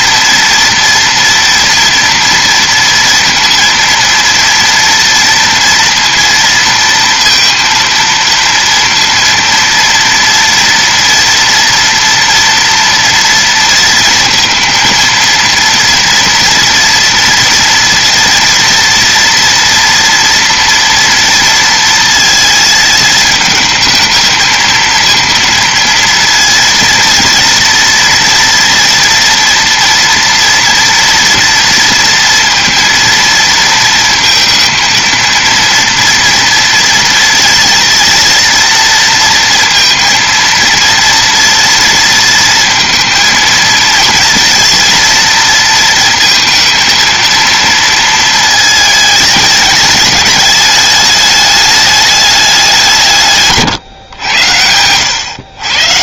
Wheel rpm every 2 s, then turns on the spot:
230, 230, 230, 230, 230, 230, 240, 230, 240, 230, 230, 220, 230, 230, 230, 230, 230, 230, 230, 230, 230, 230, 230, 230, 220, 210, 160, 100.
none